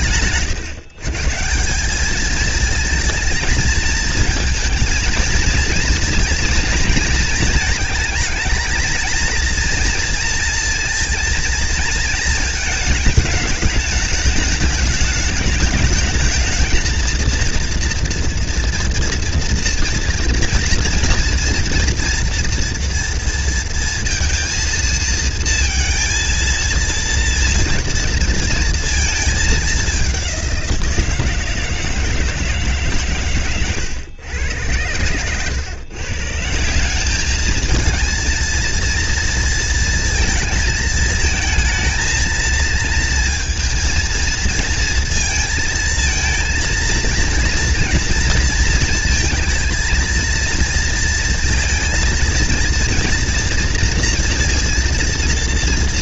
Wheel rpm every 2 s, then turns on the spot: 140, 220, 220, 230, 230, 230, 210, 210, 230, 230, 240, 230, 230, 230, 220, 170, 130, 120, 210, 230, 220, 230, 230, 230, 230, 230, 230, 230.
none